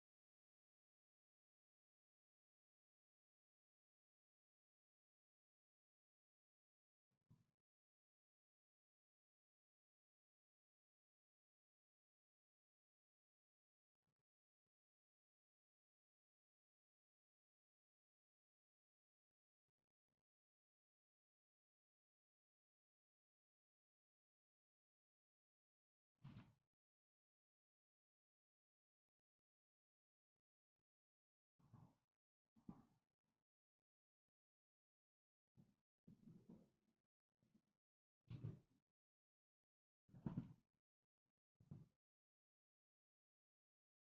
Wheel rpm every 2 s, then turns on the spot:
0, 0, 0, 0, 0, 0, 0, 0, 0, 0, 0, 0, 0, 0, 0, 0, 0, 0, 0, 0, 0, 0.
none